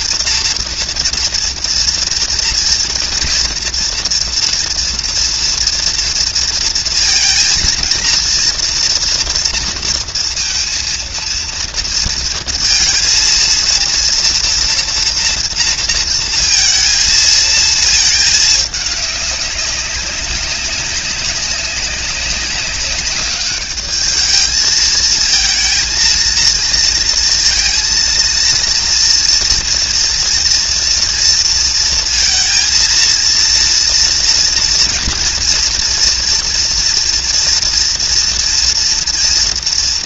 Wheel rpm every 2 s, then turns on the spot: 230, 230, 230, 230, 230, 230, 230, 230, 230, 210, 190, 200, 220, 230, 230, 240, 230, 230, 230, 230.
none